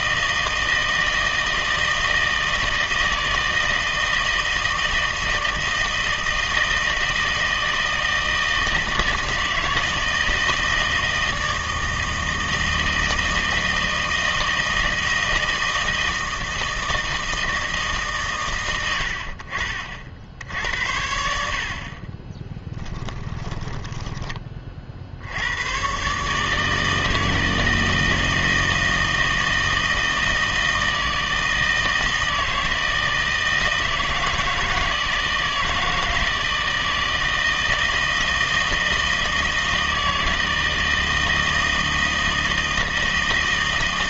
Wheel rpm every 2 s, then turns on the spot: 160, 160, 160, 160, 160, 160, 160, 160, 160, 110, 80, 20, 30, 150, 160, 160, 160, 160, 160, 160, 160, 160.
22-24